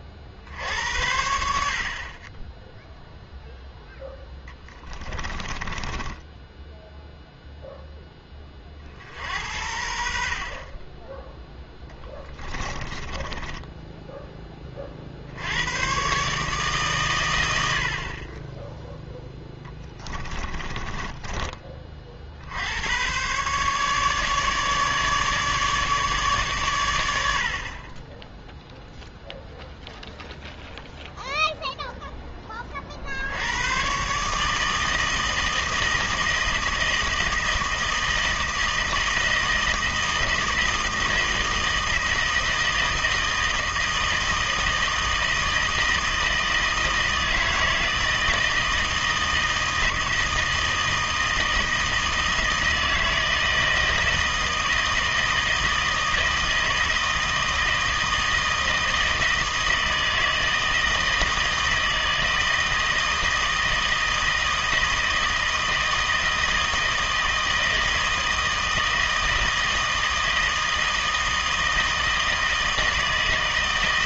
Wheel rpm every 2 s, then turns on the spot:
70, 10, 10, 0, 30, 40, 20, 30, 140, 10, 20, 80, 150, 120, 0, 0, 30, 160, 160, 160, 160, 160, 160, 160, 160, 160, 160, 160, 160, 160, 160, 160, 160, 160, 160, 160, 160.
4-6 12-14 20-22